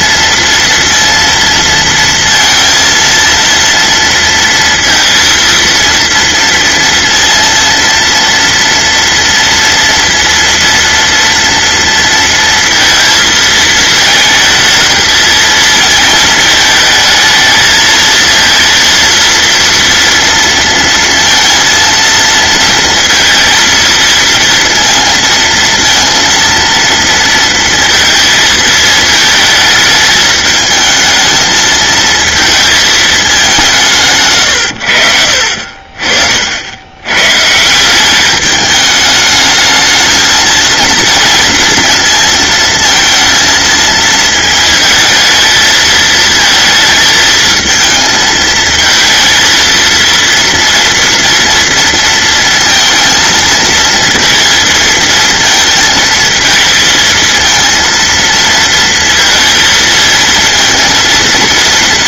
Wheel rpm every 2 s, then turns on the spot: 230, 230, 230, 230, 230, 230, 230, 220, 230, 220, 230, 230, 230, 230, 230, 220, 220, 190, 60, 140, 220, 230, 230, 220, 220, 230, 230, 230, 220, 220, 230.
none